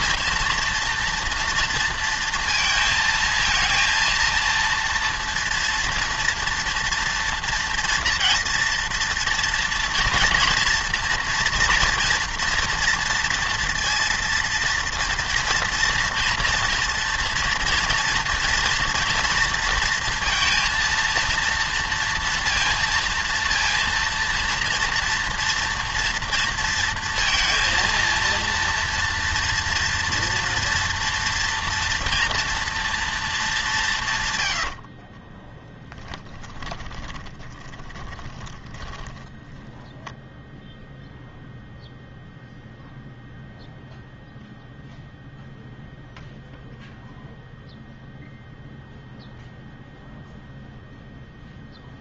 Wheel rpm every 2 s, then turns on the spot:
230, 230, 230, 230, 240, 240, 230, 230, 240, 230, 230, 230, 230, 230, 230, 230, 230, 80, 10, 10, 0, 0, 0, 0, 0, 0.
34-40